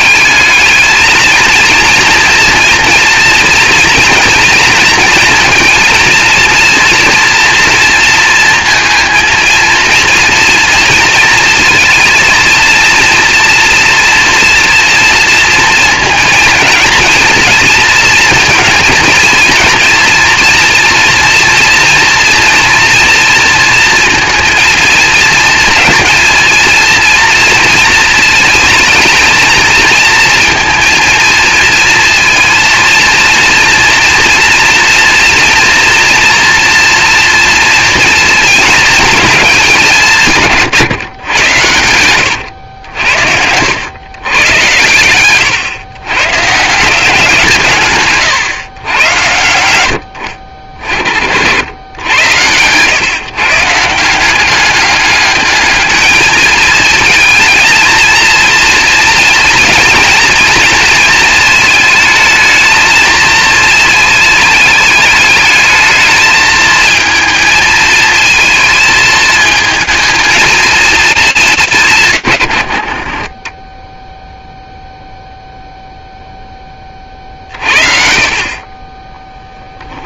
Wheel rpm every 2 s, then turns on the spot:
220, 230, 230, 230, 230, 230, 230, 230, 230, 230, 230, 230, 230, 230, 230, 230, 230, 230, 230, 220, 140, 90, 100, 170, 120, 50, 120, 200, 230, 230, 220, 220, 210, 220, 220, 230, 50, 0, 20, 30.
42-46